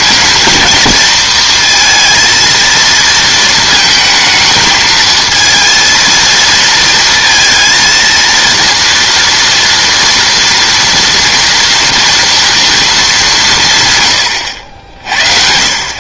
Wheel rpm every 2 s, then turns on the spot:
220, 230, 220, 230, 230, 230, 230, 60.
none